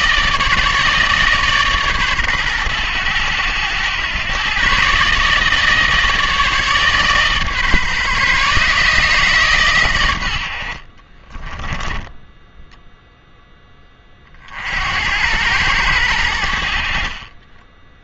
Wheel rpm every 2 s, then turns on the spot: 150, 110, 130, 150, 150, 60, 10, 60, 70.
none